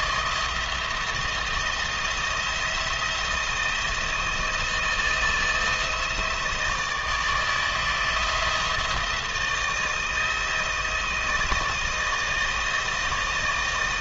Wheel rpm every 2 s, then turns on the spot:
170, 170, 160, 160, 170, 160, 160.
none